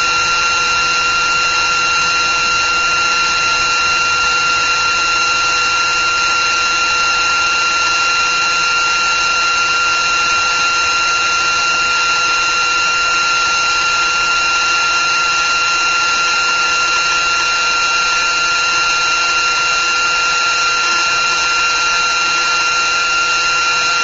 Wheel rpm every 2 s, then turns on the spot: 360, 360, 360, 370, 370, 370, 360, 360, 360, 360, 360, 360.
none